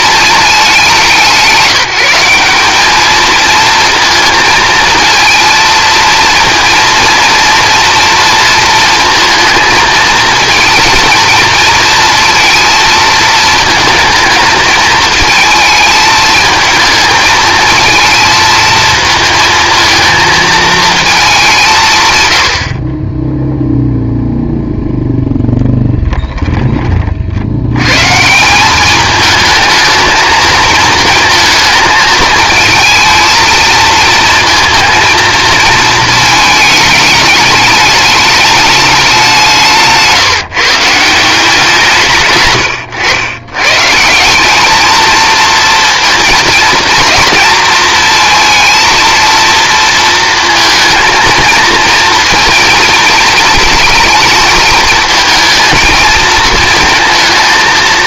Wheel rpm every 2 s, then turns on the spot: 190, 210, 220, 230, 230, 230, 230, 220, 220, 220, 220, 40, 0, 20, 190, 220, 220, 230, 220, 210, 160, 110, 220, 230, 230, 230, 220, 220, 220.
22-24